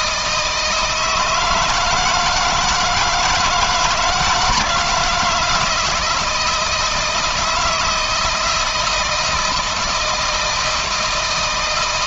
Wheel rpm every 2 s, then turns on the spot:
160, 160, 170, 160, 160, 160.
none